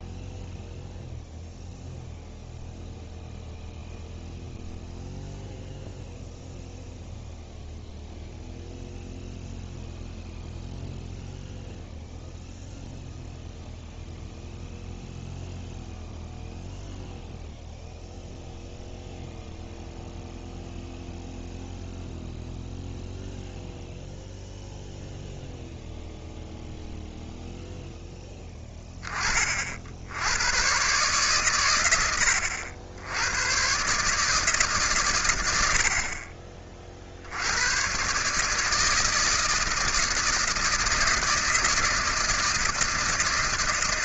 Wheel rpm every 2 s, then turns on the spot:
0, 0, 0, 0, 0, 0, 0, 0, 0, 0, 0, 0, 0, 0, 10, 90, 100, 150, 50, 140, 160, 160.
none